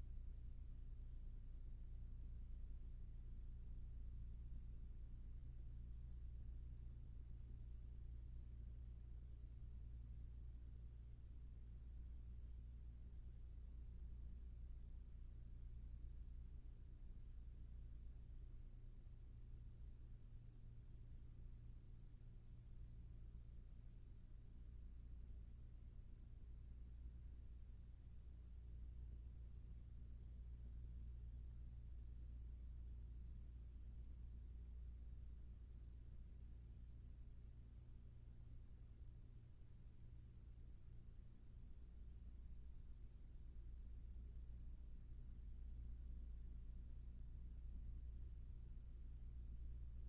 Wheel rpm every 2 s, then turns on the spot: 0, 0, 0, 0, 0, 0, 0, 0, 0, 0, 0, 0, 0, 0, 0, 0, 0, 0, 0, 0, 0, 0, 0, 0, 0.
none